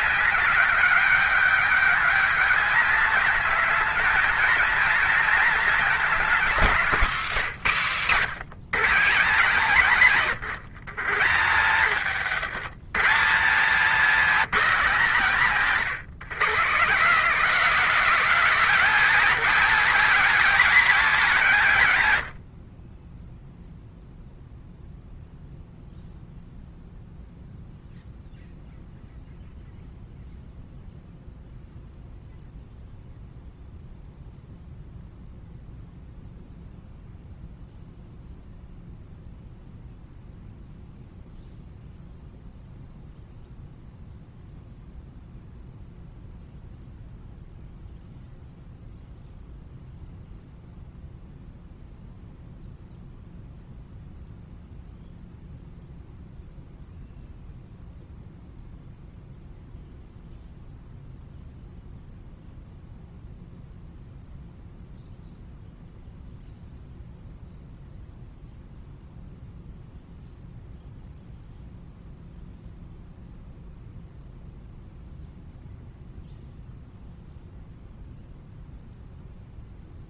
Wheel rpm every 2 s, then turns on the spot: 200, 220, 220, 210, 190, 150, 160, 230, 190, 260, 260, 50, 0, 0, 0, 0, 0, 0, 0, 0, 0, 0, 0, 0, 0, 0, 0, 0, 0, 0, 0, 0, 0, 0, 0, 0, 0, 0, 0, 0.
none